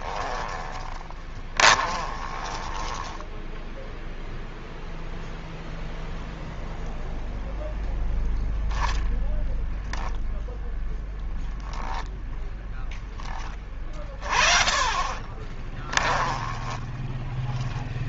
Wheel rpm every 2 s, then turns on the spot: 10, 20, 0, 0, 10, 10, 10, 30, 10.
0-4 8-12 16-18